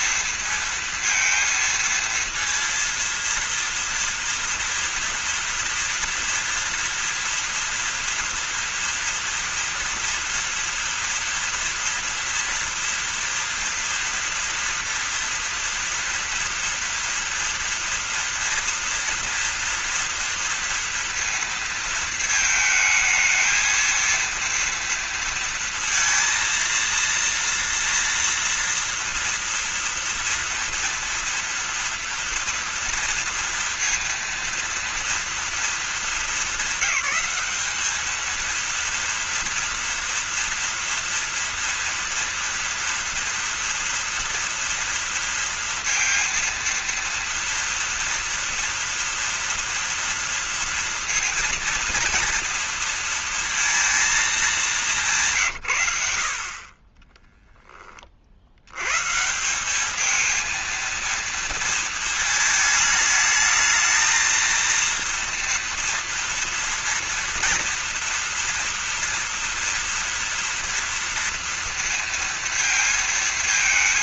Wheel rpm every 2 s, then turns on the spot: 220, 230, 240, 240, 230, 230, 230, 230, 230, 230, 230, 220, 230, 230, 230, 230, 230, 230, 220, 230, 230, 230, 230, 230, 230, 230, 230, 200, 40, 70, 220, 220, 230, 230, 230, 230, 230.
none